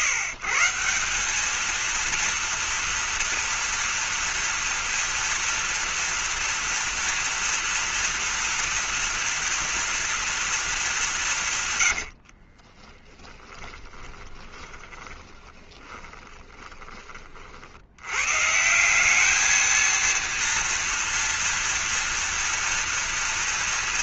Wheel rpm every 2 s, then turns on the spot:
170, 230, 240, 230, 230, 220, 40, 30, 20, 160, 230, 230.
12-16